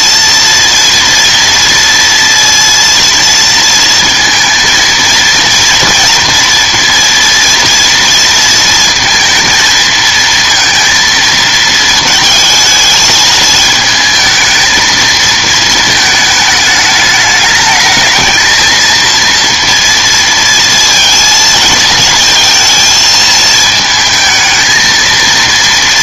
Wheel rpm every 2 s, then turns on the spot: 230, 230, 230, 230, 230, 230, 220, 220, 220, 230, 230, 230, 220.
none